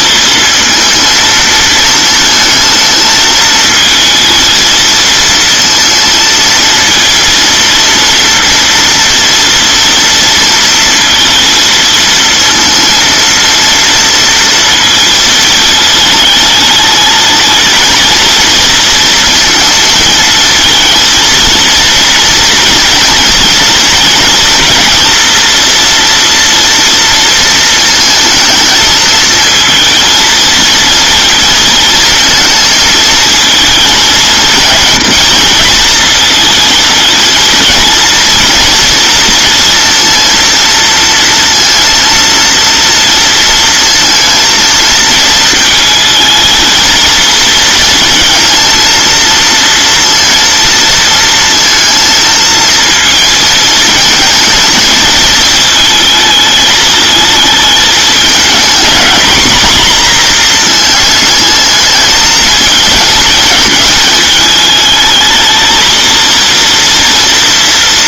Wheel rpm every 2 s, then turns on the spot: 230, 220, 220, 230, 230, 230, 230, 220, 220, 230, 230, 230, 230, 230, 220, 230, 220, 230, 230, 230, 230, 230, 230, 230, 230, 230, 220, 220, 220, 220, 230, 220, 220, 230.
none